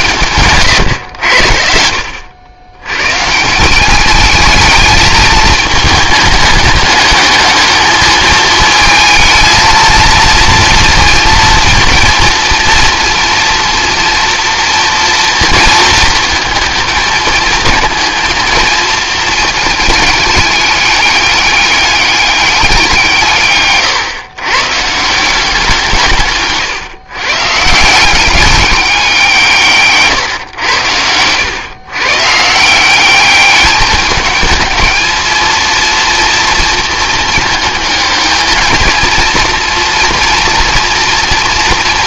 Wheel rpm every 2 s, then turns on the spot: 130, 100, 220, 210, 220, 230, 230, 230, 220, 230, 210, 190, 130, 140, 200, 100, 170, 220, 230, 220, 230.
none